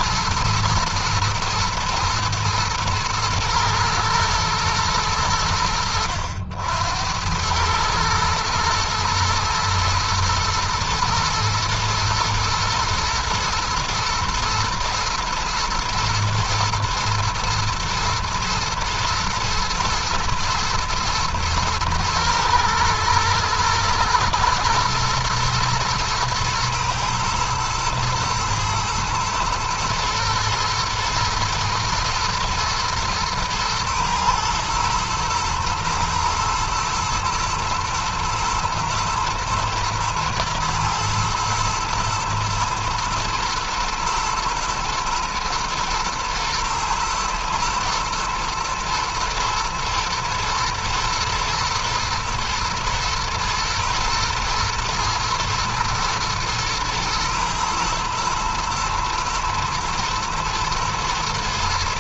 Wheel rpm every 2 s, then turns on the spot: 120, 110, 90, 100, 110, 110, 120, 110, 120, 110, 120, 120, 120, 120, 110, 120, 110, 120, 110, 110, 120, 110, 110, 110, 110, 110, 110, 120, 120, 110, 120.
none